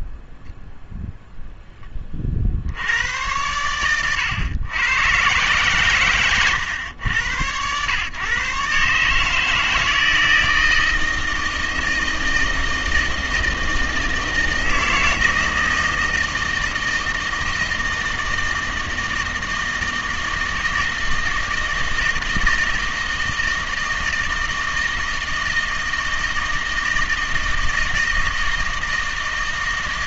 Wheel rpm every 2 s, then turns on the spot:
0, 60, 110, 110, 140, 160, 160, 160, 160, 160, 160, 160, 160, 160, 160.
none